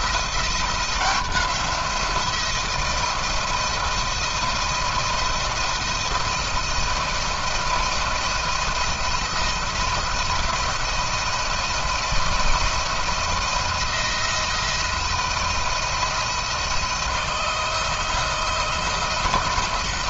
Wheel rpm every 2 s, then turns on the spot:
170, 170, 170, 170, 170, 170, 170, 170, 160, 160.
none